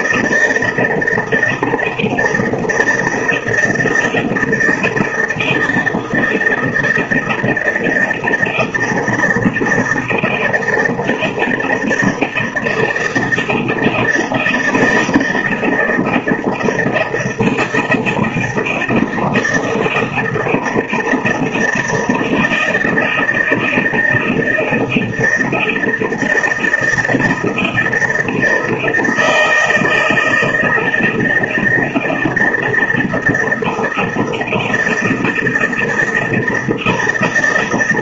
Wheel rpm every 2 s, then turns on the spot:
160, 160, 160, 160, 160, 160, 160, 160, 160, 160, 160, 160, 160, 160, 160, 160, 160, 160, 160.
none